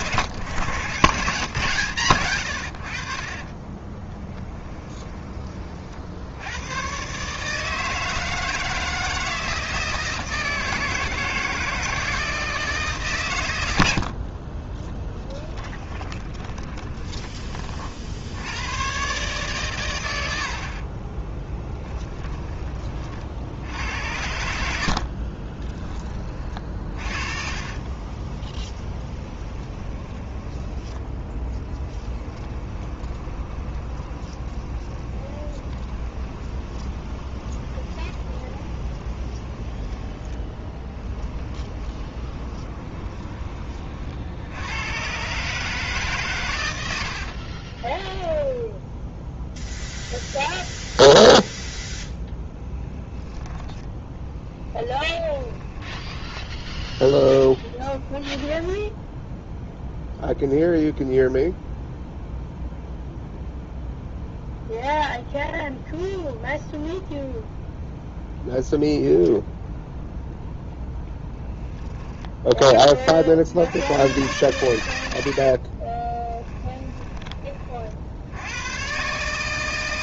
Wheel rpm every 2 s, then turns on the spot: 130, 60, 20, 120, 160, 160, 150, 30, 20, 120, 40, 30, 60, 40, 30, 10, 20, 20, 20, 20, 20, 20, 110, 70, 0, 0, 10, 10, 10, 0, 0, 0, 0, 0, 0, 10, 30, 100, 10, 120.
4-6 14-18 20-22 24-44 52-58 76-78